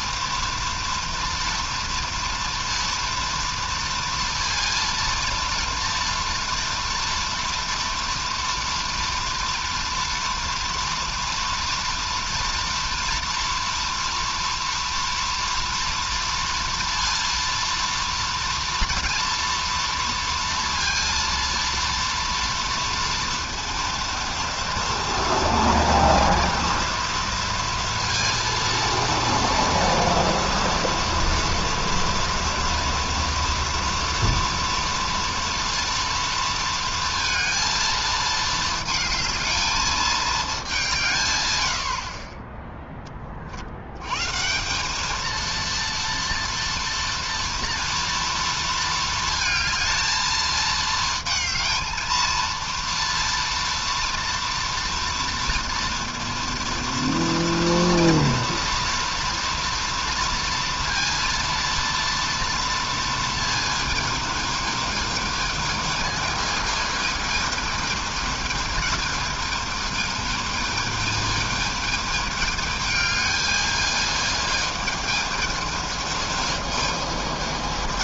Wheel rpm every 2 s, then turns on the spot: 230, 230, 230, 240, 230, 230, 230, 230, 230, 230, 230, 230, 230, 230, 230, 230, 230, 230, 230, 220, 210, 20, 160, 230, 230, 220, 230, 230, 230, 230, 230, 230, 220, 220, 220, 220, 220, 220, 220.
none